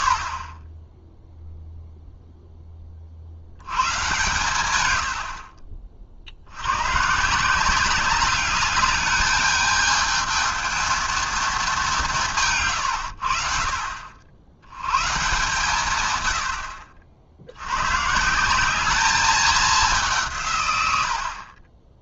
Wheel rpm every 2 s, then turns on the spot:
20, 20, 110, 100, 210, 220, 140, 100, 70, 190, 100.
none